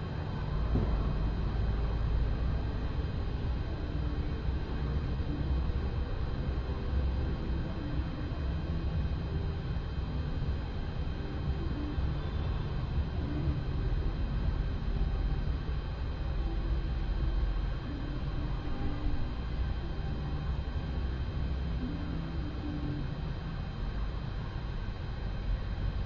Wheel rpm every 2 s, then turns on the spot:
0, 0, 0, 0, 0, 0, 0, 0, 0, 0, 0, 0, 0.
none